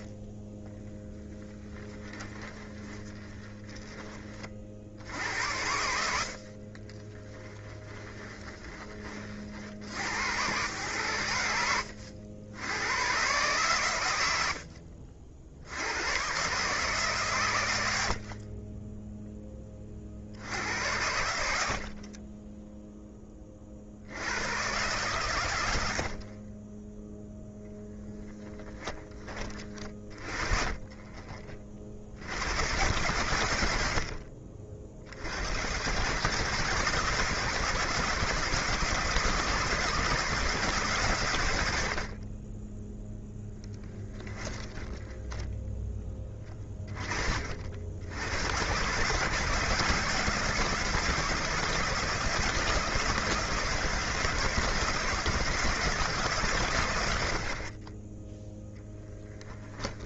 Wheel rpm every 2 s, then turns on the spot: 20, 10, 70, 20, 20, 100, 100, 40, 140, 30, 90, 10, 120, 20, 10, 20, 110, 60, 170, 160, 150, 10, 10, 30, 120, 170, 160, 160, 110, 0.
0-4 6-8 44-46